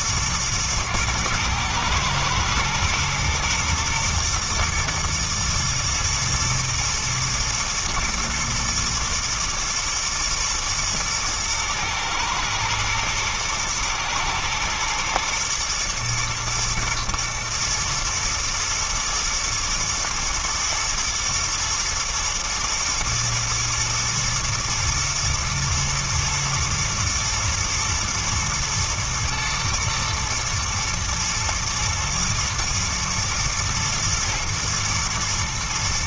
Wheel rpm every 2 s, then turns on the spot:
110, 110, 110, 110, 120, 110, 110, 110, 110, 120, 120, 110, 120, 110, 110, 110, 110, 120.
none